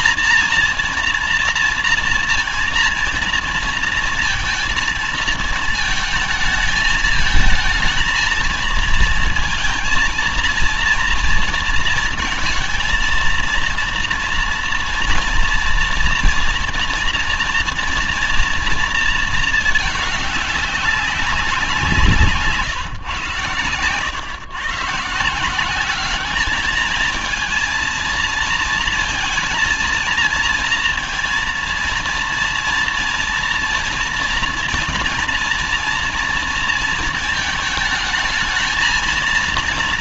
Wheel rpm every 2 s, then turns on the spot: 230, 230, 230, 220, 220, 230, 230, 240, 230, 230, 200, 150, 130, 220, 220, 220, 230, 230, 230, 220.
none